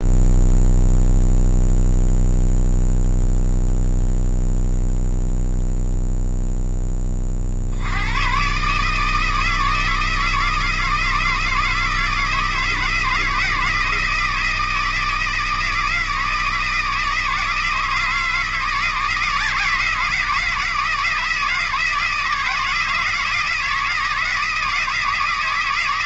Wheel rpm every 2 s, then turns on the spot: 0, 0, 0, 20, 160, 160, 160, 160, 160, 160, 160, 160, 160.
none